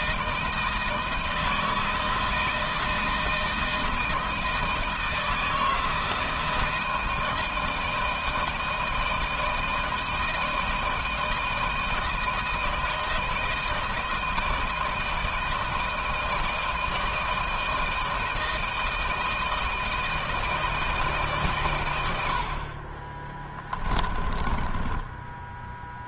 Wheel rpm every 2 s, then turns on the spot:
160, 160, 160, 170, 160, 160, 160, 160, 160, 160, 150, 30, 10.
22-26